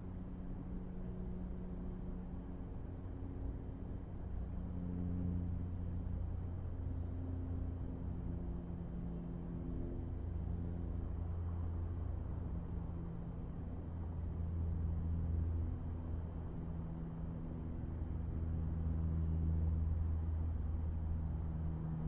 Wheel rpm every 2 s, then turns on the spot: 0, 0, 0, 0, 0, 0, 0, 0, 0, 0, 0.
none